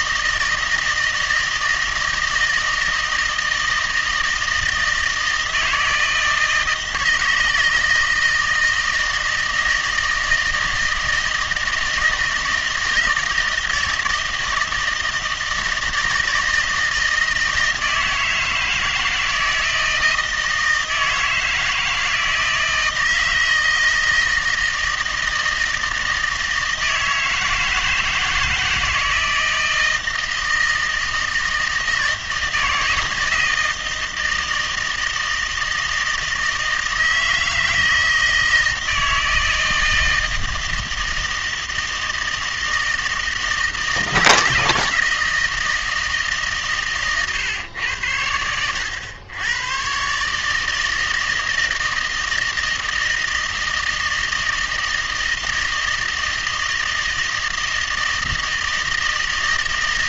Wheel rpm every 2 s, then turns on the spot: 160, 160, 160, 160, 160, 160, 160, 160, 160, 160, 160, 160, 160, 160, 160, 160, 160, 160, 160, 160, 160, 160, 160, 140, 100, 160, 160, 160, 160, 160.
none